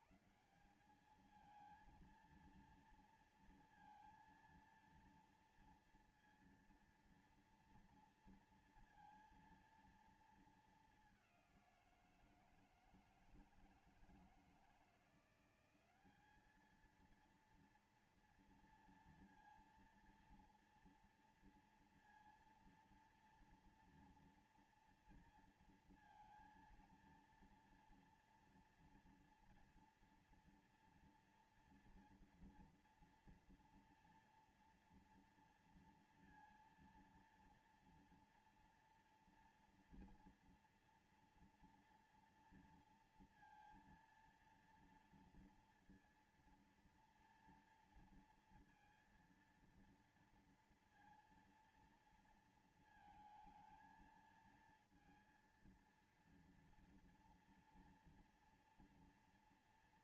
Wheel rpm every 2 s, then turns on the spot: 140, 220, 230, 230, 230, 230, 180, 160, 190, 230, 230, 230, 230, 230, 230, 230, 230, 230, 230, 230, 230, 230, 230, 230, 230, 230, 230, 230, 230, 240.
none